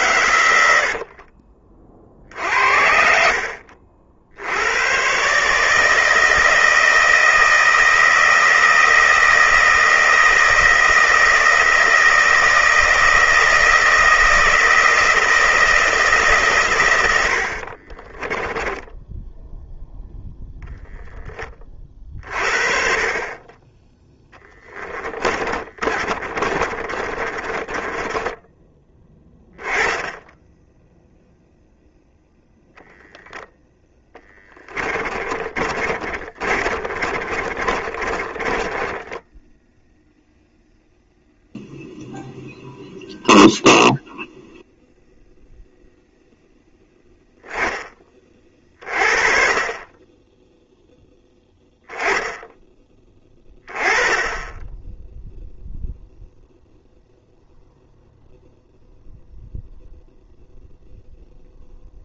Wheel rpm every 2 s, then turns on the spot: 70, 50, 110, 160, 160, 160, 160, 160, 100, 10, 20, 40, 20, 30, 10, 0, 0, 20, 30, 20, 0, 0, 0, 20, 30, 0, 10, 10, 0, 0, 0.
0-2 18-20 24-28 34-40